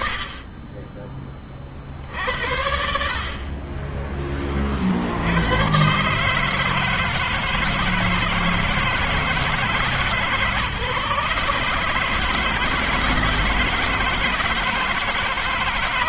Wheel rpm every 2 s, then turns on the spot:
30, 40, 100, 160, 160, 150, 160, 160.
none